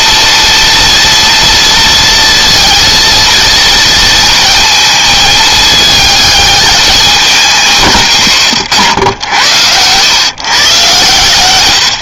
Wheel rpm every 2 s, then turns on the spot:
230, 230, 220, 200, 90, 120.
none